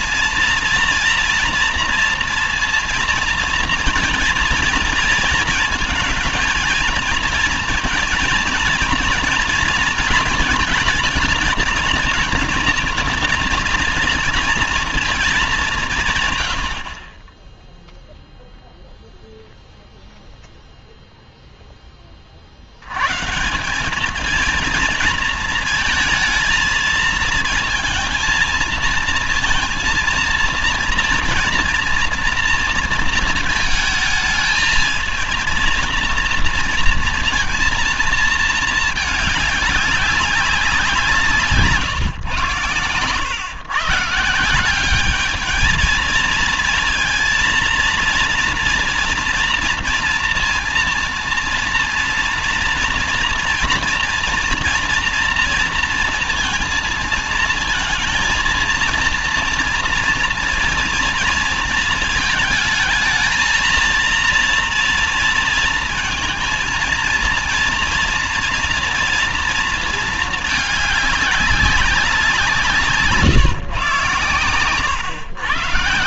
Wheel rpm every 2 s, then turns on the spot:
240, 230, 230, 230, 220, 230, 230, 230, 80, 0, 0, 70, 220, 220, 230, 230, 230, 220, 230, 220, 180, 120, 180, 230, 230, 230, 240, 230, 230, 230, 240, 220, 230, 220, 230, 220, 160, 110.
none